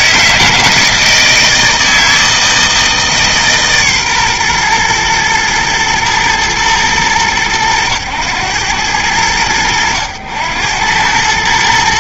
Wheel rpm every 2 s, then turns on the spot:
160, 160, 120, 110, 100, 100.
none